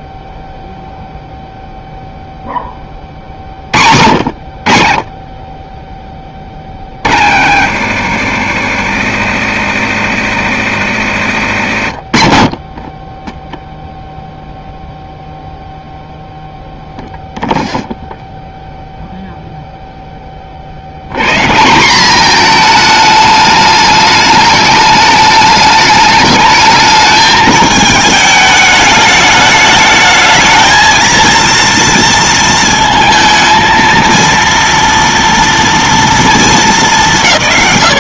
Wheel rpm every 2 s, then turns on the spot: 0, 30, 50, 50, 70, 80, 20, 0, 0, 0, 70, 220, 210, 220, 210, 220, 230, 230, 210.
none